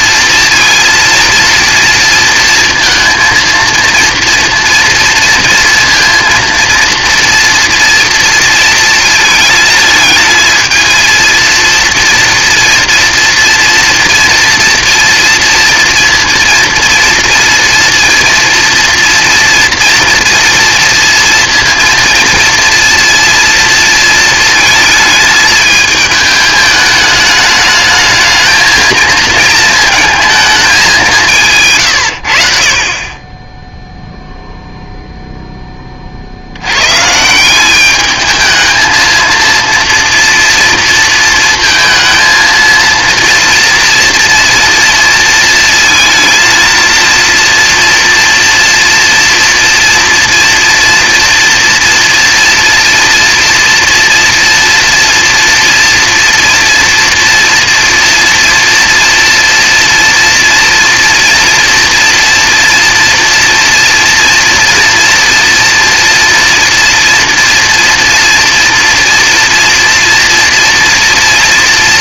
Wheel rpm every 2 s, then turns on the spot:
230, 230, 230, 230, 230, 220, 230, 230, 230, 230, 230, 230, 220, 220, 220, 210, 50, 0, 90, 220, 230, 230, 230, 230, 230, 230, 230, 240, 240, 230, 230, 230, 240, 230, 230, 230.
none